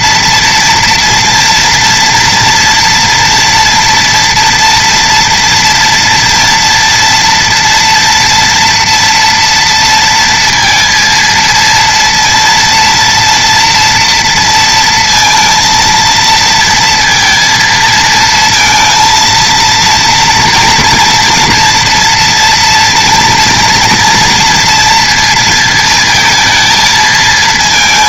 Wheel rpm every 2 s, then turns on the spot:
230, 230, 230, 230, 230, 230, 230, 230, 230, 230, 230, 230, 230, 220.
none